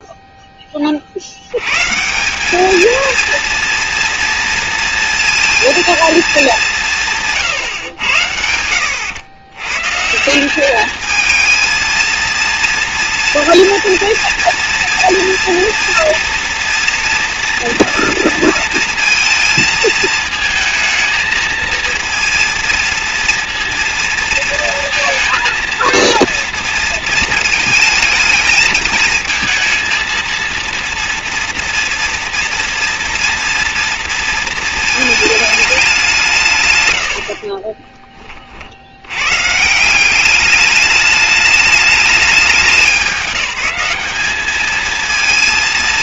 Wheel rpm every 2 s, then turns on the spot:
20, 210, 230, 200, 90, 200, 230, 230, 230, 230, 220, 230, 230, 230, 220, 230, 230, 230, 140, 50, 200, 200, 220.
8-10